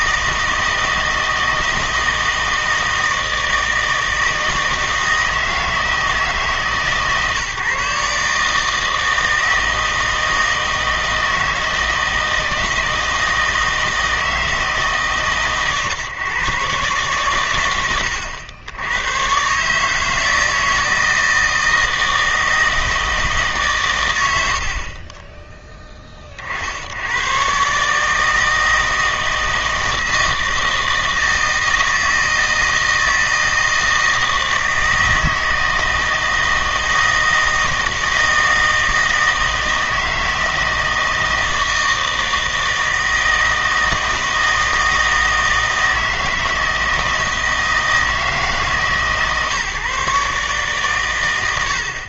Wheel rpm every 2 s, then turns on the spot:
160, 160, 160, 150, 160, 160, 160, 160, 130, 90, 160, 160, 60, 70, 160, 160, 160, 160, 160, 160, 160, 160, 160, 160, 160, 130.
none